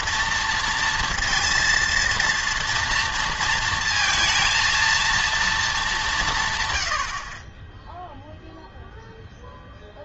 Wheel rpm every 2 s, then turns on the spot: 230, 230, 230, 120, 0.
none